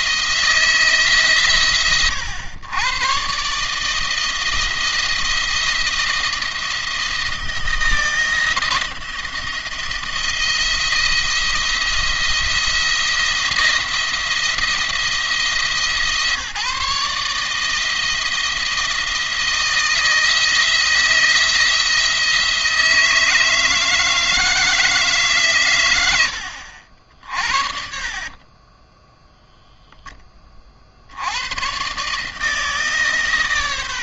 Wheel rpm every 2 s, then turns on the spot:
160, 110, 160, 170, 170, 170, 170, 160, 140, 160, 170, 160, 160, 70, 20, 40, 150.
28-30